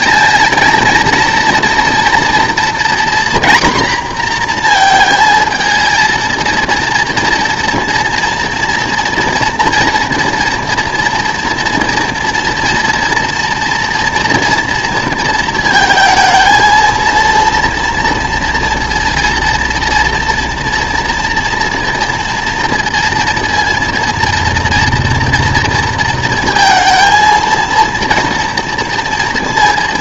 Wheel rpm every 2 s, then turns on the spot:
230, 240, 230, 230, 230, 230, 230, 230, 230, 230, 230, 230, 230, 230, 230.
none